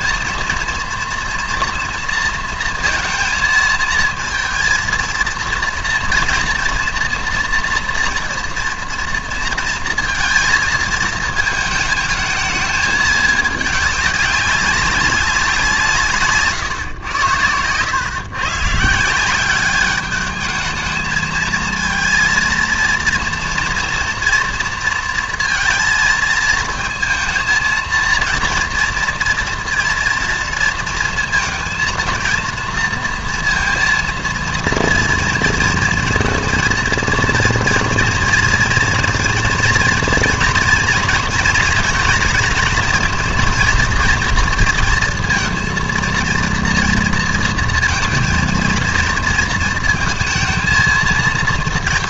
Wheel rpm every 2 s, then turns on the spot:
230, 230, 230, 230, 230, 230, 220, 200, 140, 130, 220, 230, 230, 220, 230, 230, 230, 230, 230, 240, 230, 230, 230, 230, 230, 230.
none